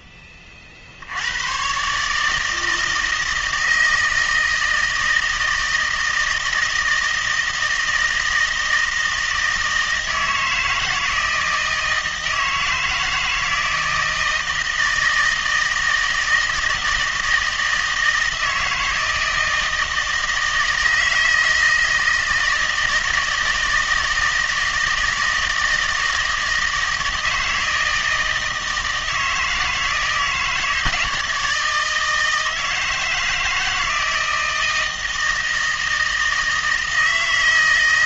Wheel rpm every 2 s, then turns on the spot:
60, 160, 160, 160, 160, 160, 160, 160, 160, 160, 160, 160, 160, 160, 160, 160, 160, 160, 160.
none